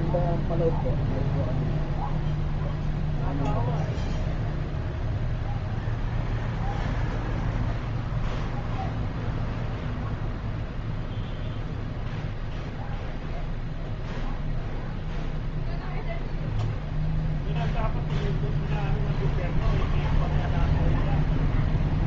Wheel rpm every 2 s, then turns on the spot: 0, 0, 0, 0, 0, 0, 0, 0, 0, 0, 0.
none